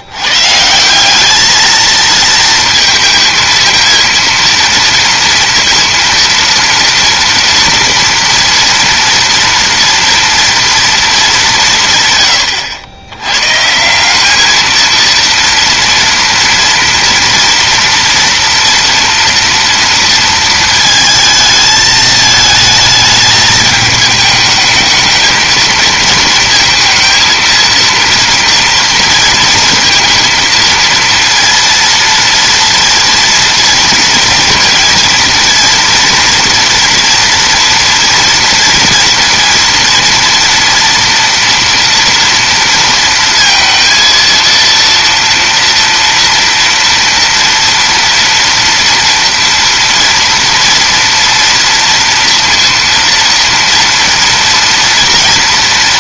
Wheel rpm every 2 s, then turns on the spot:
170, 230, 230, 230, 240, 230, 100, 220, 230, 230, 220, 220, 220, 230, 230, 230, 230, 230, 230, 230, 230, 230, 230, 230, 230, 230, 230, 230.
none